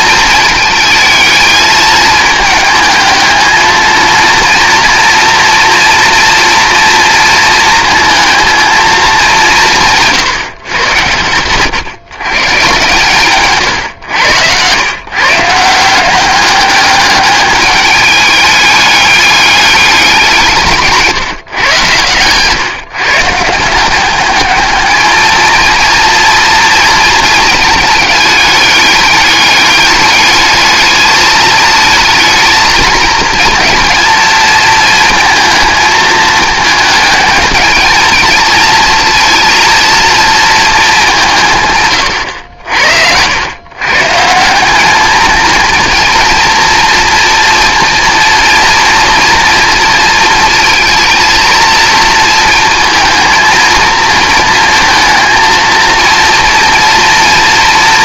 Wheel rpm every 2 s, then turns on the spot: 220, 220, 240, 230, 220, 130, 140, 110, 200, 210, 160, 130, 210, 230, 210, 210, 220, 220, 220, 220, 220, 80, 190, 230, 230, 230, 230, 230, 230.
none